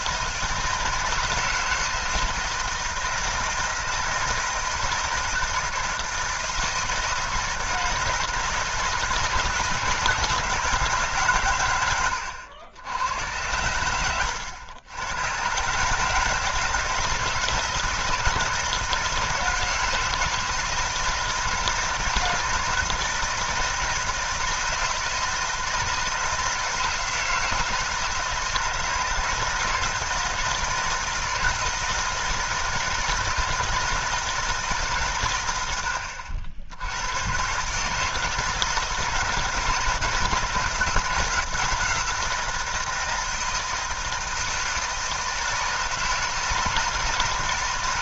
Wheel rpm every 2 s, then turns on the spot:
160, 160, 160, 160, 160, 150, 90, 110, 160, 160, 160, 160, 160, 160, 160, 170, 160, 160, 80, 160, 170, 170, 160, 160.
none